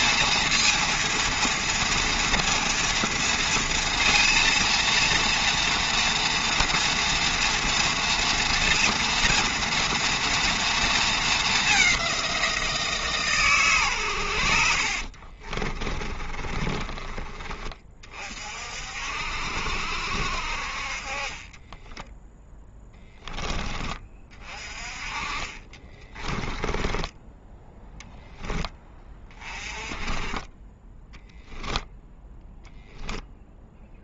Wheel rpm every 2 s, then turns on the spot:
230, 230, 230, 230, 230, 230, 170, 70, 30, 50, 50, 10, 30, 20, 10, 10, 0.
14-18 22-24